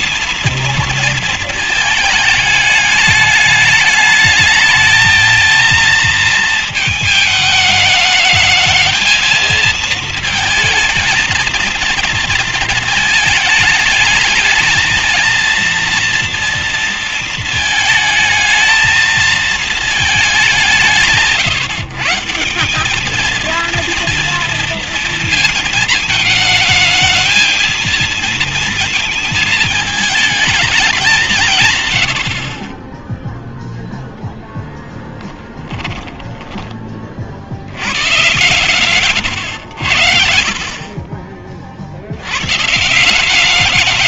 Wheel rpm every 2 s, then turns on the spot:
230, 210, 220, 220, 220, 220, 220, 220, 230, 220, 190, 180, 230, 220, 230, 210, 30, 10, 20, 130, 40, 140.
none